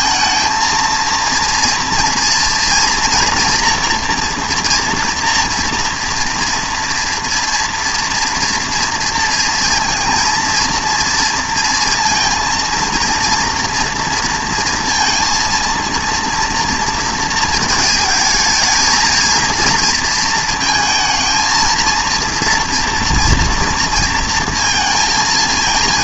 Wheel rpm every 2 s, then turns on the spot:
230, 230, 240, 230, 230, 230, 230, 230, 230, 220, 230, 230, 230.
none